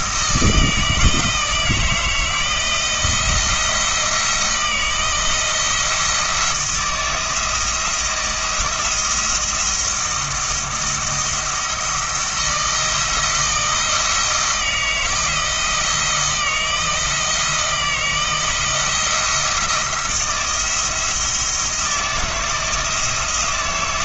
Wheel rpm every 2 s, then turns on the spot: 160, 170, 170, 160, 170, 170, 160, 160, 160, 170, 170, 160.
none